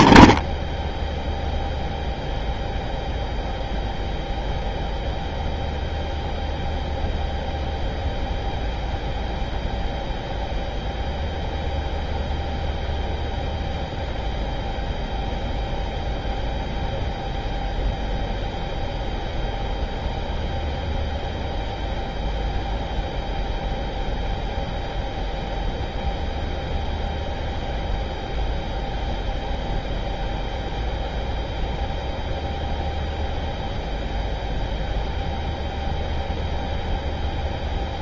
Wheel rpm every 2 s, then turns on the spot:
0, 0, 0, 0, 0, 0, 0, 0, 0, 0, 0, 0, 0, 0, 0, 0, 0, 0, 0.
none